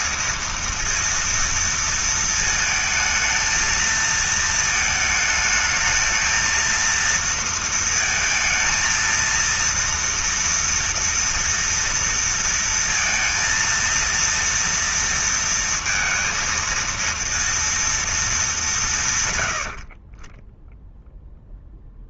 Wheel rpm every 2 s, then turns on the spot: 230, 220, 220, 230, 230, 240, 230, 230, 230, 140, 0.
none